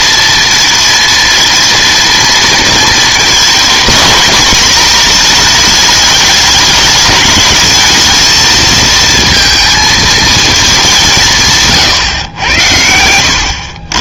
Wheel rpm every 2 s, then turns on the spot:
230, 230, 220, 210, 220, 210, 90.
none